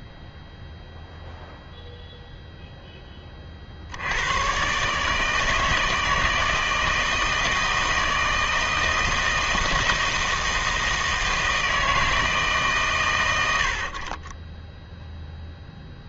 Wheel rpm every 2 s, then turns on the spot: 0, 0, 130, 160, 160, 160, 140, 10.
none